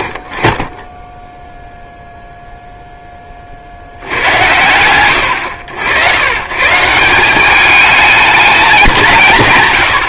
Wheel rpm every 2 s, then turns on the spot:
50, 0, 80, 130, 180.
none